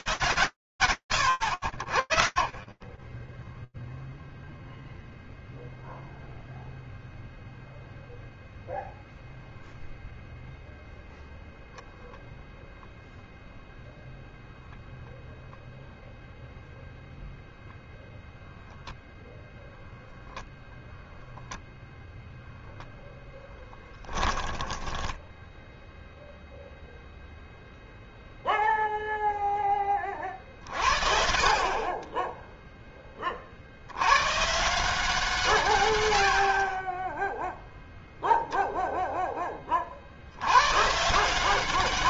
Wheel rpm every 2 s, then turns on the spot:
10, 0, 0, 0, 0, 0, 0, 0, 0, 0, 0, 10, 0, 0, 10, 30, 60, 140, 0, 20, 180.
22-24